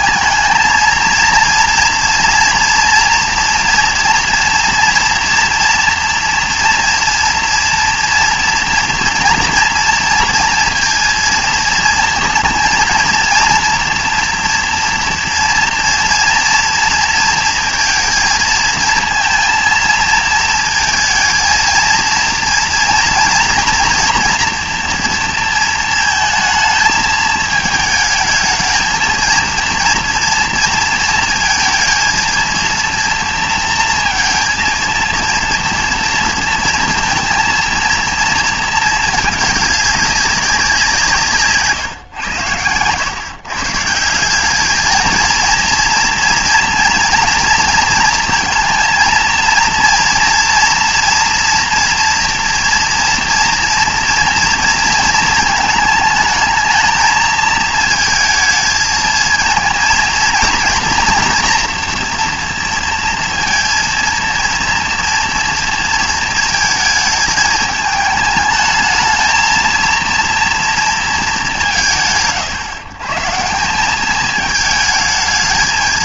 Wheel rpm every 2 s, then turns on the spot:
220, 230, 240, 230, 230, 230, 230, 230, 230, 220, 230, 230, 240, 230, 220, 230, 230, 230, 230, 230, 200, 110, 180, 230, 230, 230, 240, 230, 220, 230, 230, 230, 230, 230, 220, 230, 100, 210.
none